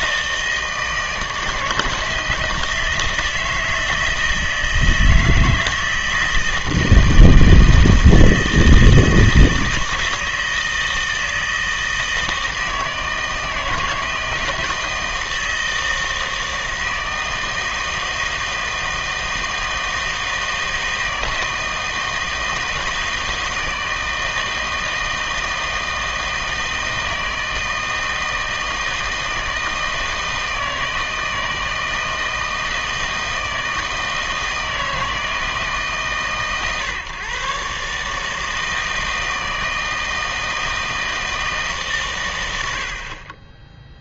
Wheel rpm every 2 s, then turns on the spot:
160, 160, 160, 160, 160, 160, 160, 160, 160, 160, 160, 160, 160, 160, 160, 160, 160, 160, 140, 160, 160, 70.
none